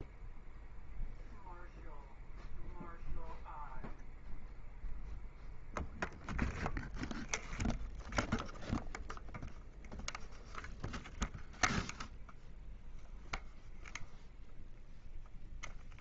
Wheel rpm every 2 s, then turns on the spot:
0, 0, 0, 0, 0, 0, 0, 0.
none